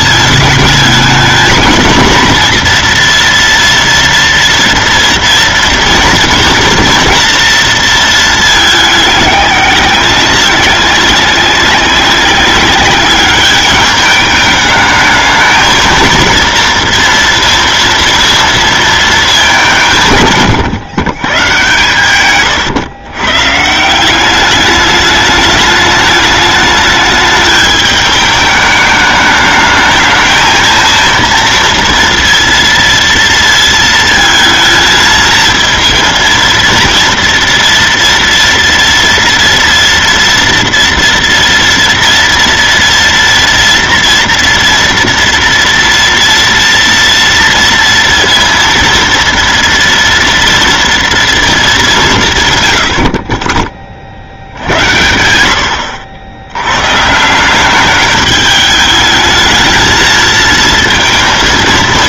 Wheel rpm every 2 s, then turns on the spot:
220, 230, 240, 230, 200, 190, 210, 230, 230, 160, 130, 160, 210, 210, 210, 230, 230, 230, 230, 230, 230, 230, 230, 230, 230, 190, 30, 80, 190, 220, 230.
none